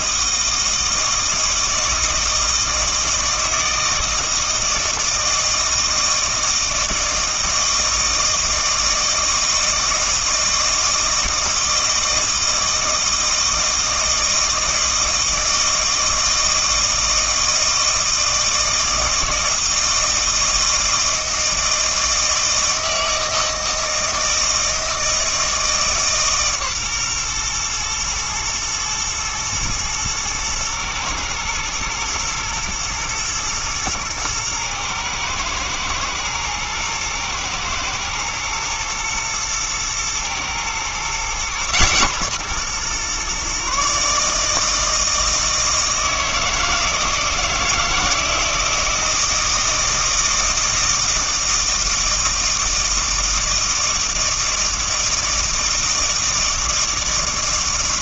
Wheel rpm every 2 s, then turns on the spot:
160, 160, 160, 160, 160, 160, 160, 160, 160, 160, 160, 160, 160, 130, 110, 110, 110, 110, 110, 110, 120, 130, 160, 160, 160, 160, 160, 160, 160.
none